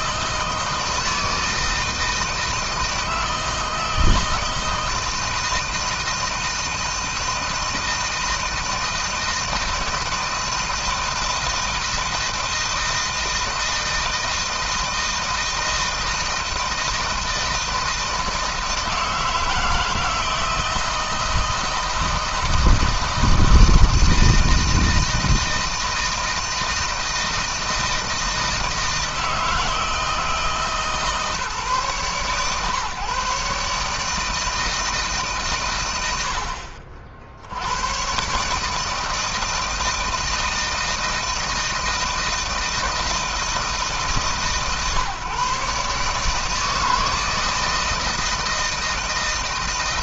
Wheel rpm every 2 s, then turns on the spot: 160, 160, 160, 160, 160, 160, 160, 160, 160, 160, 160, 160, 160, 160, 160, 150, 130, 160, 70, 160, 160, 160, 140, 160, 160.
none